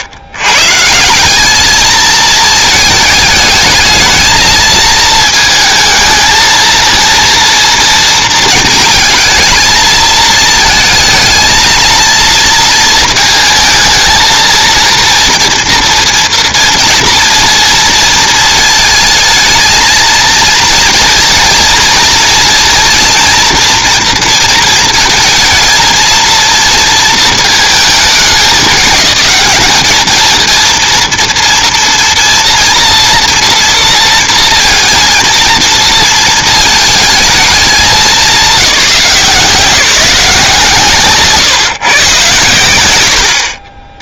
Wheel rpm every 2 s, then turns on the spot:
100, 220, 220, 220, 230, 220, 230, 230, 230, 220, 230, 230, 230, 230, 210, 230, 230, 230, 230, 200, 160, 120.
none